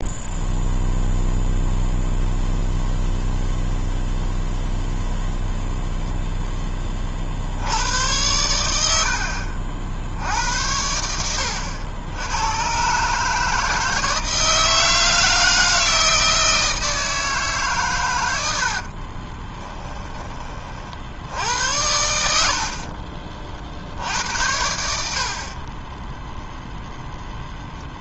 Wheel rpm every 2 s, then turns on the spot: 0, 0, 0, 20, 80, 90, 140, 160, 160, 50, 60, 50, 80, 0.
18-20 22-24